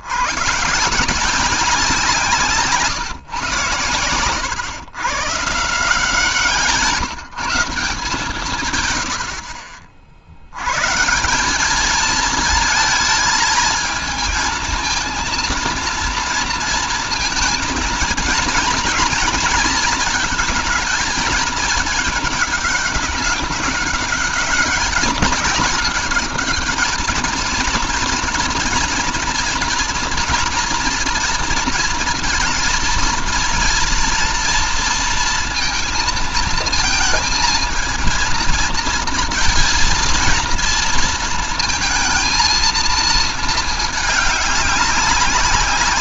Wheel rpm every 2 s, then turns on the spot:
150, 160, 110, 170, 130, 110, 220, 230, 230, 230, 230, 210, 200, 210, 230, 240, 230, 230, 220, 230, 230, 230, 200.
none